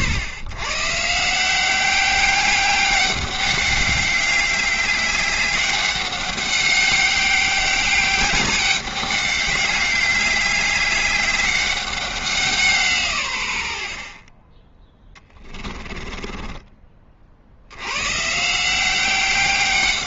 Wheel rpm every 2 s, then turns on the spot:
110, 190, 200, 200, 200, 190, 170, 20, 20, 170.
16-18